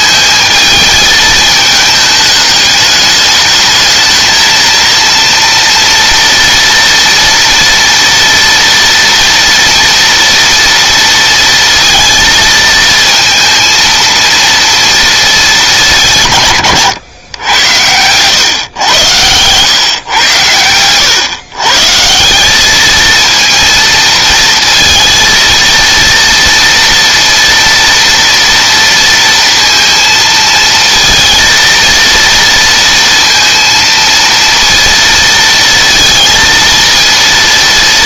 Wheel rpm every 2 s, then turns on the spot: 220, 210, 230, 230, 230, 230, 220, 230, 110, 110, 110, 220, 230, 230, 230, 230, 230, 230, 230.
none